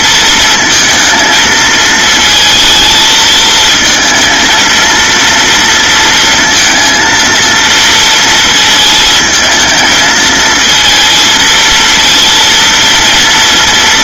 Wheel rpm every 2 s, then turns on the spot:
230, 220, 230, 230, 220, 230, 230.
none